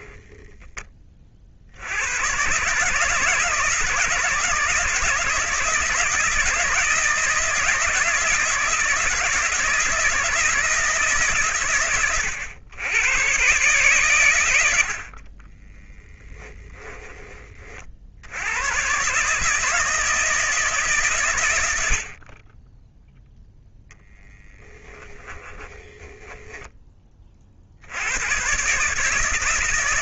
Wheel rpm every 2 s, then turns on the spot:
20, 150, 160, 160, 160, 160, 110, 60, 10, 130, 140, 0, 10, 20, 150.
16-18 24-26